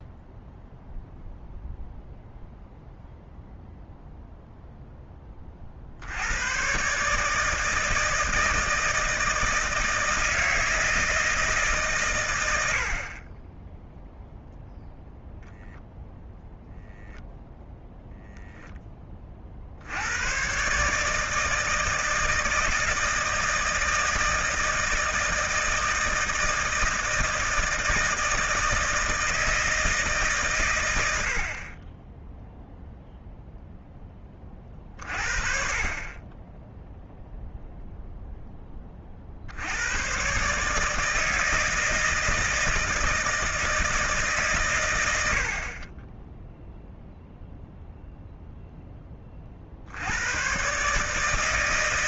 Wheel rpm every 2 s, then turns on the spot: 0, 0, 0, 110, 160, 160, 80, 0, 0, 0, 130, 160, 160, 160, 160, 120, 0, 30, 10, 20, 140, 160, 120, 0, 0, 120.
none